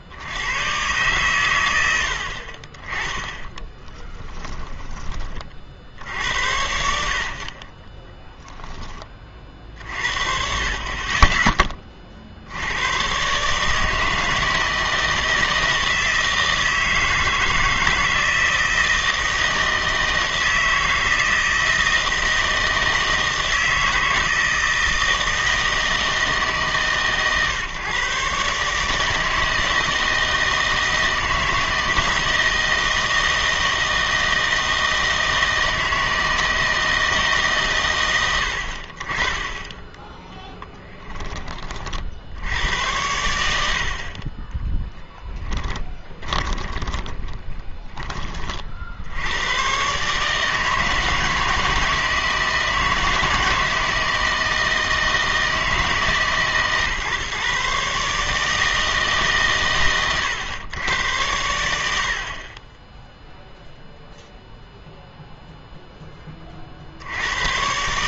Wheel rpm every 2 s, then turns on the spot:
110, 30, 20, 80, 10, 40, 100, 160, 160, 160, 160, 160, 160, 150, 140, 160, 160, 160, 160, 60, 10, 90, 10, 20, 50, 160, 160, 160, 140, 160, 110, 20, 0, 50.
4-6 40-42 44-48